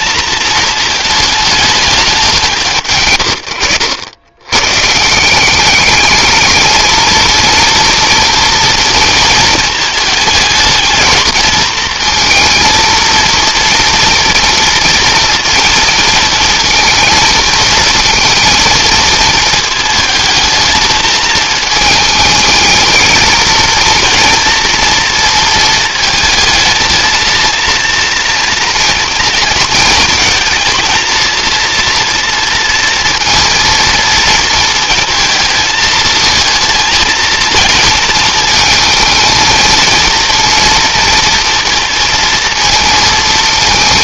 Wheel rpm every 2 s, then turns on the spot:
220, 120, 140, 220, 230, 220, 230, 230, 230, 230, 220, 220, 230, 220, 230, 230, 230, 230, 220, 220, 230, 230.
none